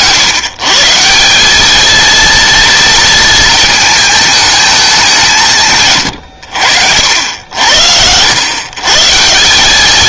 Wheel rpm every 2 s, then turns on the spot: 150, 230, 210, 90, 120.
none